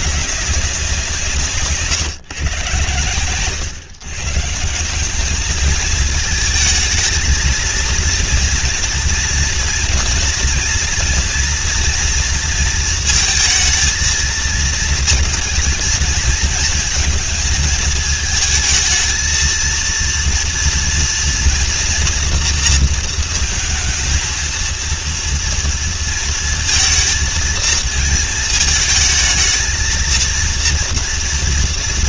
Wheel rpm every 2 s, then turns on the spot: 180, 120, 170, 220, 230, 230, 230, 220, 230, 220, 230, 230, 230, 230, 220, 230.
none